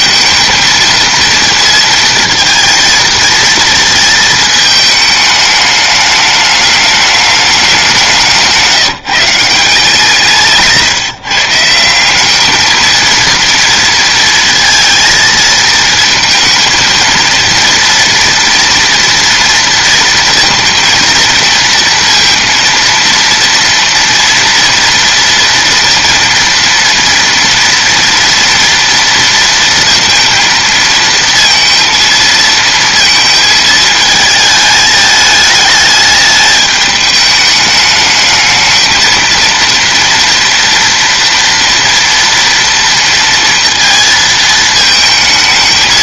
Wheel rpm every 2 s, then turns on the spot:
220, 230, 220, 210, 160, 150, 220, 230, 220, 230, 230, 230, 230, 230, 230, 230, 230, 220, 210, 220, 230, 230, 230.
none